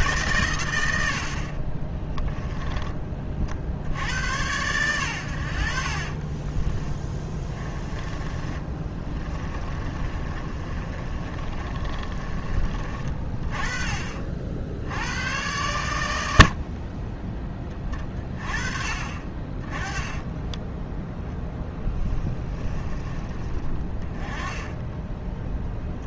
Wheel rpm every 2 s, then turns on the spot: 90, 20, 100, 10, 20, 30, 30, 80, 50, 30, 10, 20, 10.
6-12 20-22 24-26